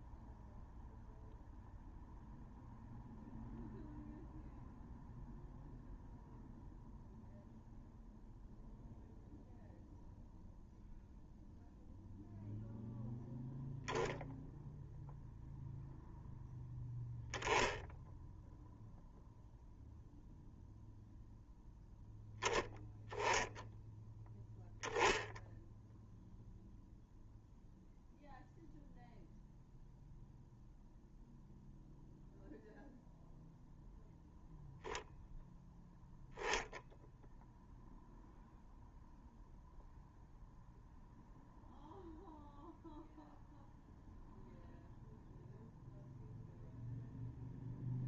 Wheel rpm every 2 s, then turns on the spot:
0, 0, 0, 0, 0, 0, 0, 0, 0, 0, 0, 10, 0, 0, 0, 0, 0, 0, 0, 0, 0, 0, 0, 0.
none